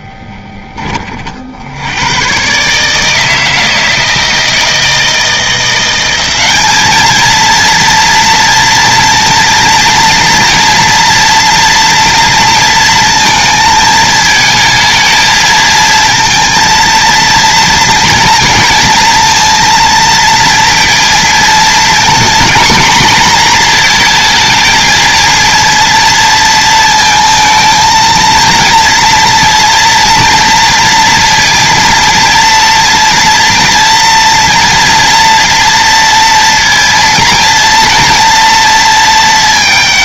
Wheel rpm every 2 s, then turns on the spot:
50, 160, 170, 230, 230, 230, 230, 220, 230, 230, 230, 230, 230, 220, 230, 230, 230, 240, 240, 190.
none